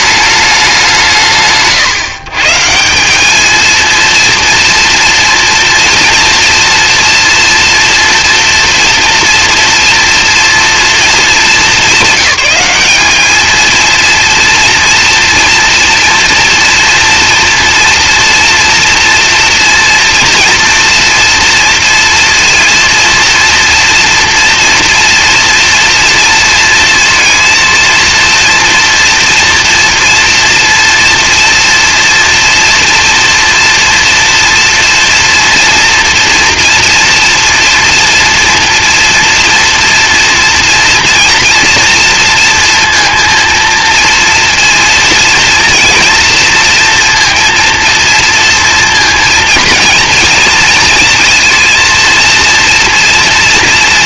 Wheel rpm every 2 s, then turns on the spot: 190, 140, 230, 230, 230, 240, 200, 230, 230, 240, 230, 230, 240, 230, 230, 230, 230, 230, 230, 230, 230, 230, 230, 230, 230, 230, 230.
none